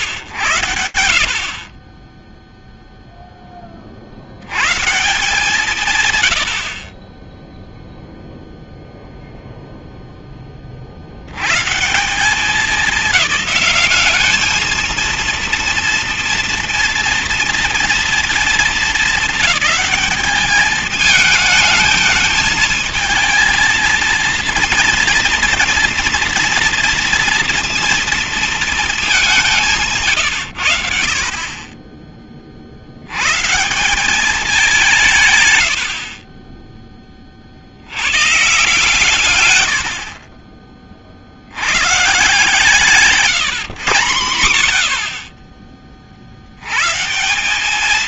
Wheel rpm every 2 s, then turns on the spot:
100, 20, 80, 100, 0, 20, 190, 210, 230, 230, 210, 220, 230, 240, 230, 150, 30, 180, 20, 130, 50, 140, 130, 40.
36-38